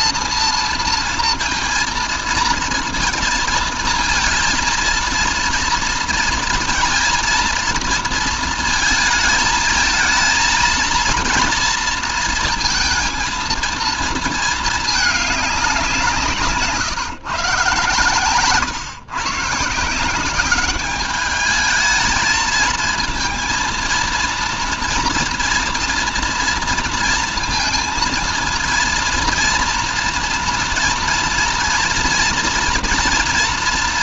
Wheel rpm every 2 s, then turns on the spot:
230, 230, 230, 230, 220, 230, 230, 220, 160, 130, 200, 220, 230, 230, 230, 230, 230.
none